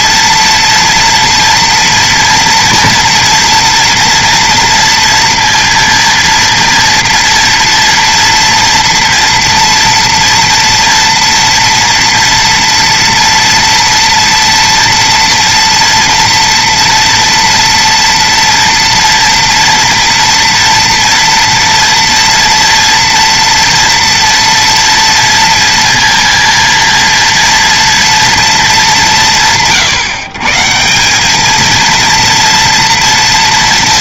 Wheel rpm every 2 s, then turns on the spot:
230, 230, 240, 230, 230, 230, 230, 230, 240, 230, 230, 230, 230, 230, 230, 130, 230.
none